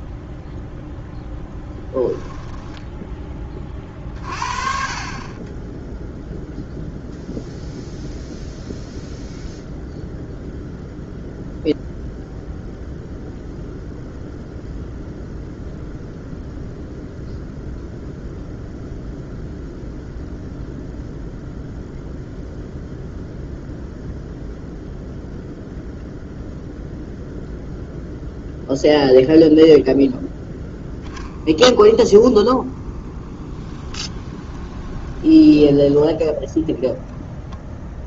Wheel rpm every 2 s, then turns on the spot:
0, 10, 40, 0, 0, 0, 0, 0, 0, 0, 0, 0, 0, 0, 0, 0, 10, 20, 0.
32-36